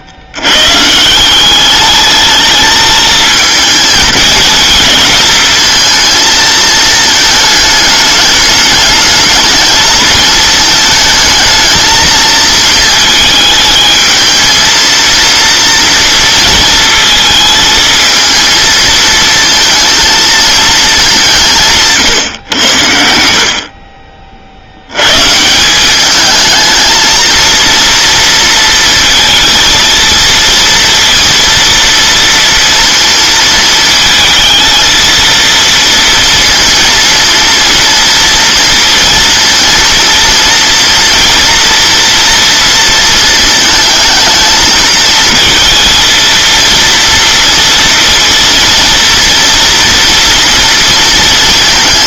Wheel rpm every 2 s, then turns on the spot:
130, 220, 220, 220, 210, 220, 220, 220, 230, 230, 220, 100, 70, 220, 230, 230, 230, 230, 230, 230, 230, 230, 220, 230, 230, 230.
none